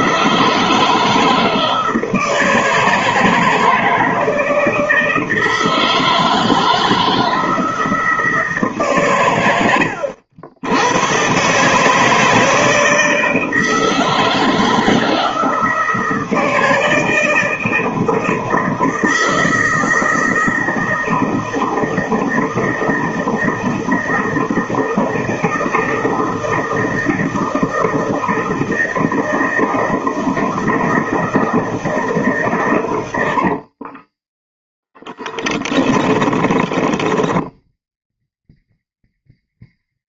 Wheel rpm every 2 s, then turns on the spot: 160, 160, 160, 160, 150, 90, 160, 160, 160, 160, 160, 160, 160, 160, 160, 160, 130, 10, 20, 0.
34-38